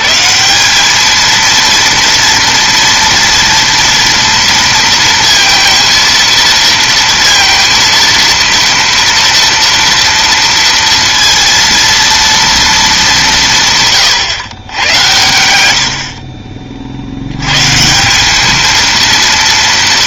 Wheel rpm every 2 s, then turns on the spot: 190, 230, 230, 230, 230, 230, 230, 110, 40, 220.
none